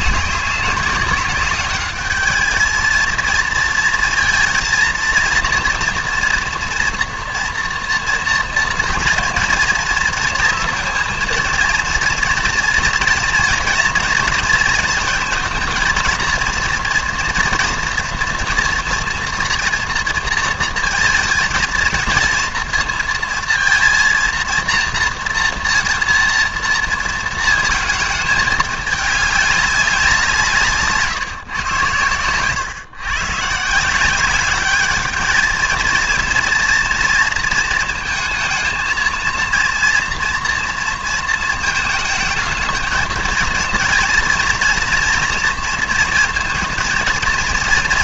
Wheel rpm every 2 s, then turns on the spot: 200, 220, 230, 240, 230, 240, 230, 230, 230, 230, 230, 230, 230, 230, 210, 160, 120, 200, 230, 220, 230, 220, 230, 230.
none